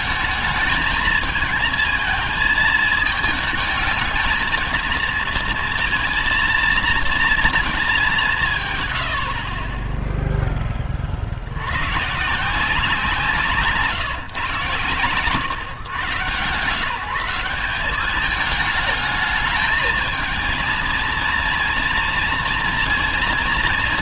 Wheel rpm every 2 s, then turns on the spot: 220, 220, 220, 230, 160, 10, 160, 130, 140, 210, 230, 230.
none